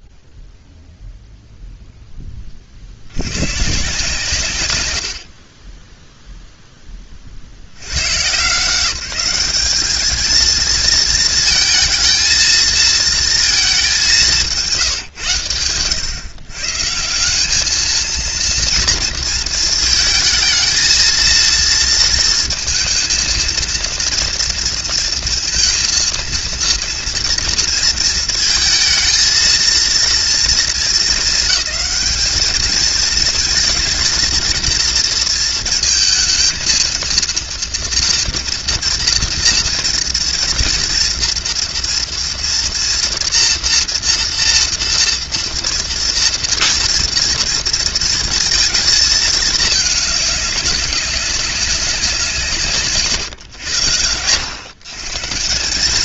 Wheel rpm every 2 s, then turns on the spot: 0, 50, 110, 10, 180, 230, 230, 150, 160, 230, 230, 230, 230, 230, 220, 220, 220, 230, 230, 230, 230, 230, 240, 230, 220, 190, 130, 140.
none